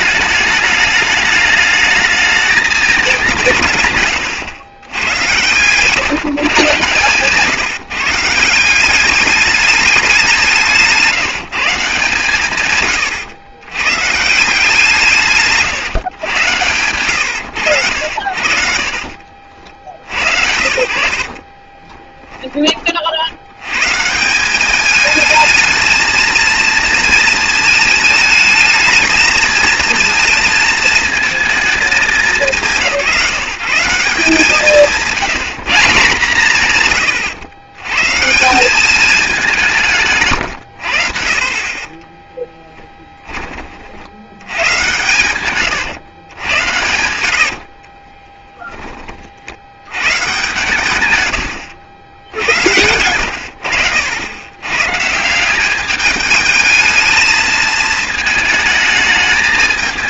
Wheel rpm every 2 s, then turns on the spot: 210, 210, 100, 130, 170, 170, 130, 170, 100, 60, 80, 20, 200, 230, 220, 220, 190, 170, 140, 180, 100, 10, 110, 100, 10, 140, 80, 110, 220, 220.
18-20 42-52